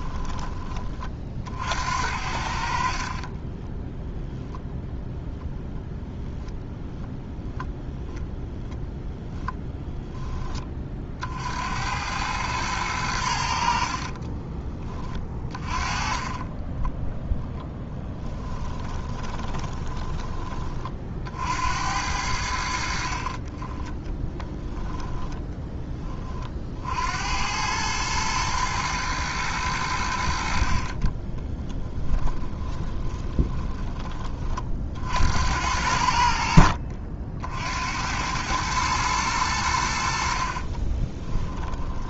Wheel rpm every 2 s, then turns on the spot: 40, 40, 0, 0, 0, 40, 100, 20, 10, 20, 40, 60, 10, 70, 110, 50, 20, 60, 60, 110, 40.
2-4 18-20 24-26 30-34 40-42